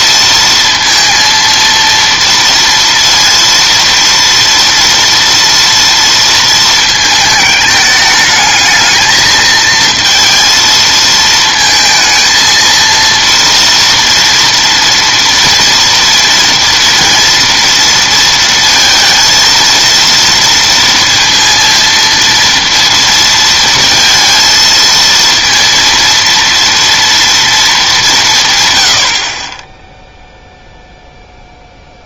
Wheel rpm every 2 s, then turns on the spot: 230, 230, 230, 230, 220, 230, 230, 230, 230, 230, 230, 230, 230, 230, 120, 0.
none